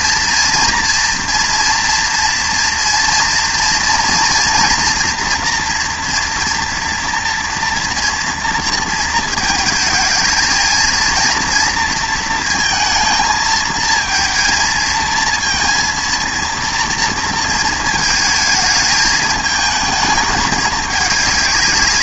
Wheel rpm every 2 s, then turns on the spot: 230, 230, 230, 240, 230, 230, 230, 230, 230, 220, 210.
none